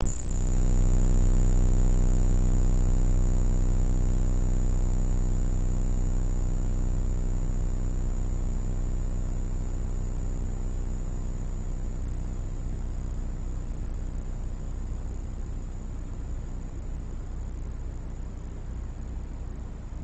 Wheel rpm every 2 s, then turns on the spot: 0, 0, 0, 0, 0, 0, 0, 0, 0, 0.
none